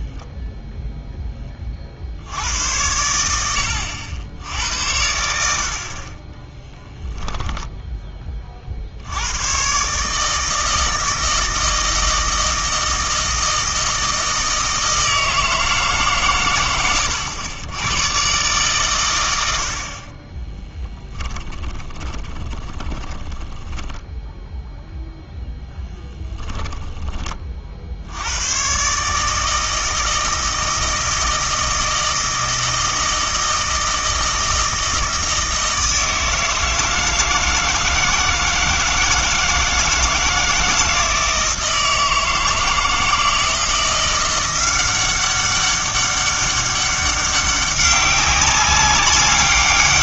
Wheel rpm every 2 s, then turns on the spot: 0, 80, 80, 10, 50, 160, 160, 160, 120, 120, 10, 20, 0, 10, 120, 160, 160, 160, 160, 160, 160, 160, 180, 200, 200.
6-8 20-24